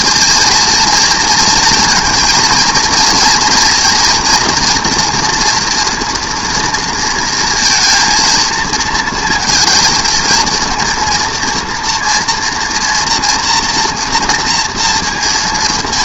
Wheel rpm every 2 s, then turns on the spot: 230, 230, 240, 230, 230, 230, 240, 230.
none